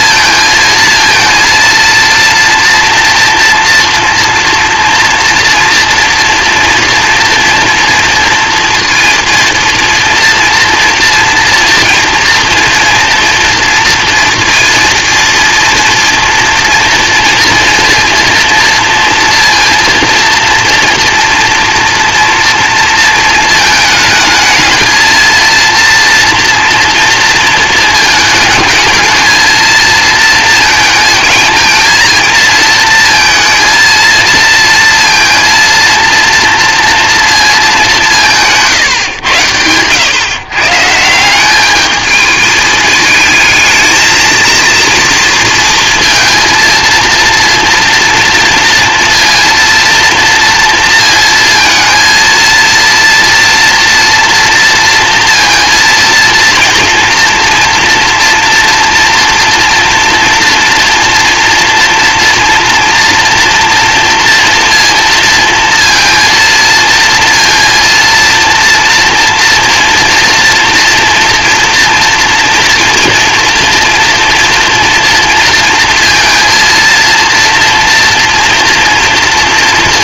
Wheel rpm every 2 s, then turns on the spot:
230, 230, 230, 230, 230, 230, 240, 230, 230, 230, 230, 230, 230, 240, 220, 230, 230, 230, 230, 140, 150, 220, 230, 230, 230, 230, 230, 230, 230, 230, 230, 230, 230, 230, 230, 240, 230, 230, 230, 230.
none